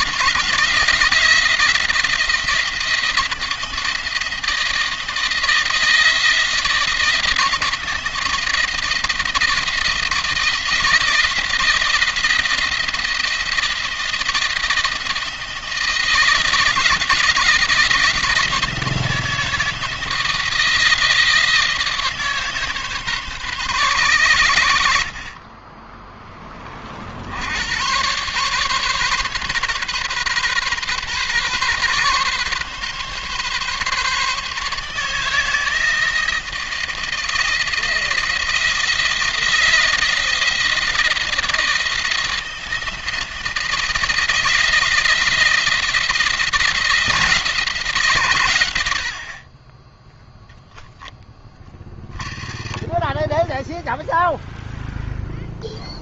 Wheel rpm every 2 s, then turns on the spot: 160, 170, 160, 160, 160, 170, 170, 160, 170, 160, 160, 140, 70, 30, 140, 130, 140, 150, 170, 170, 160, 160, 160, 160, 80, 10, 30, 0.
50-54